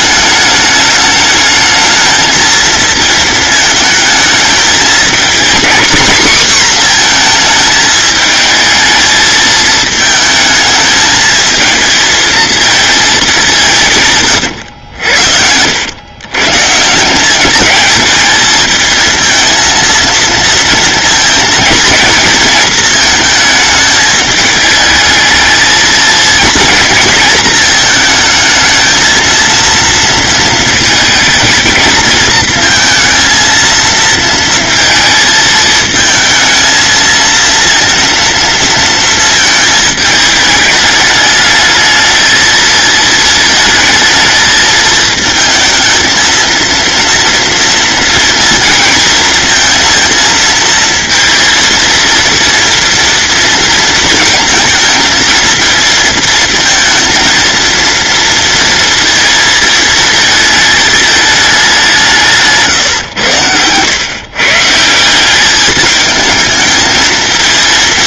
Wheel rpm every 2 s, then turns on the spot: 210, 220, 230, 250, 220, 220, 220, 100, 160, 220, 230, 230, 210, 230, 220, 220, 220, 220, 220, 230, 210, 220, 220, 230, 230, 220, 230, 220, 230, 230, 220, 140, 160, 220.
none